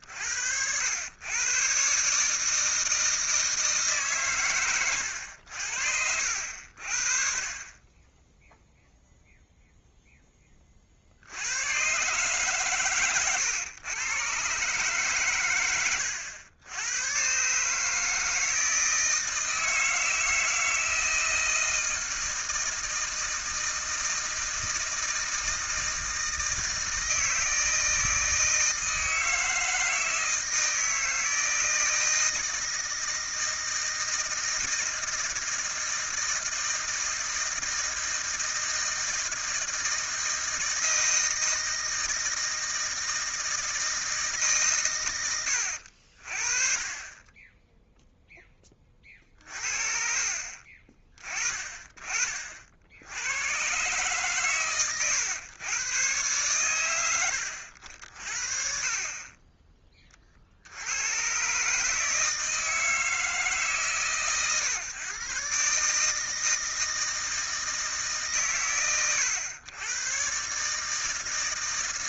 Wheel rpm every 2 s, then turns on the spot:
80, 160, 110, 70, 0, 30, 140, 140, 100, 160, 160, 160, 160, 160, 160, 160, 160, 160, 160, 160, 160, 160, 150, 30, 20, 30, 50, 120, 120, 60, 70, 160, 130, 160, 100, 140.
none